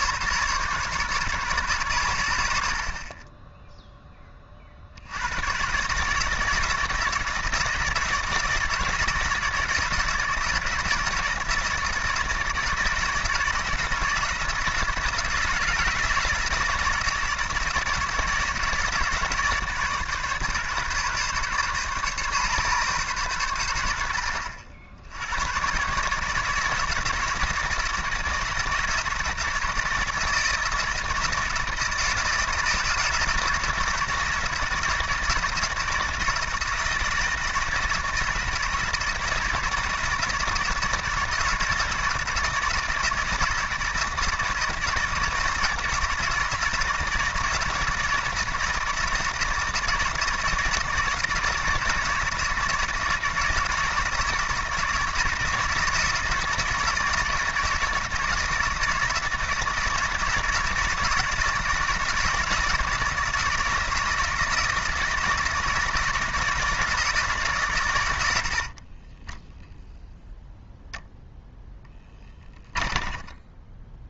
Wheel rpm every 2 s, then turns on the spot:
140, 60, 40, 160, 160, 160, 160, 170, 160, 160, 140, 140, 70, 160, 160, 160, 160, 170, 160, 160, 160, 160, 160, 160, 160, 160, 160, 160, 160, 160, 160, 160, 160, 160, 60, 0, 10.
68-70 72-74